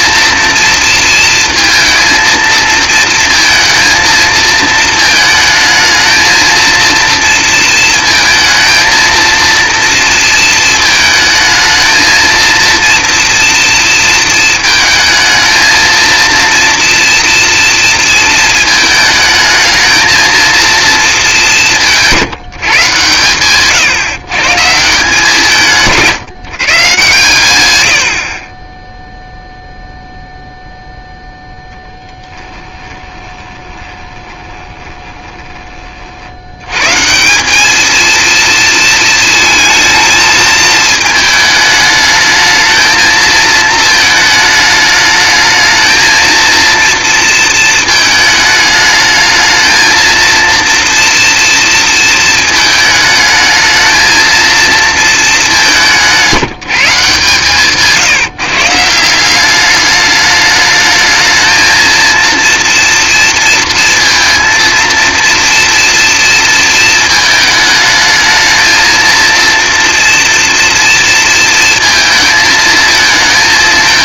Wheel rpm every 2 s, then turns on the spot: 230, 230, 220, 230, 230, 220, 230, 230, 230, 220, 230, 150, 150, 140, 30, 0, 20, 20, 130, 230, 220, 220, 210, 230, 220, 230, 220, 220, 150, 160, 220, 230, 230, 220, 220, 230, 220.
32-36